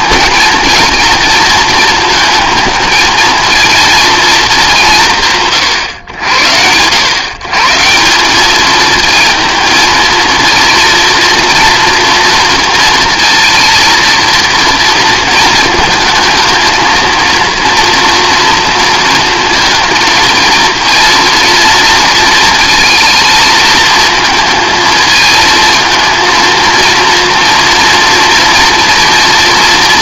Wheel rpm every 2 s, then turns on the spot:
230, 220, 140, 100, 220, 230, 230, 230, 220, 230, 230, 230, 220, 230, 230.
none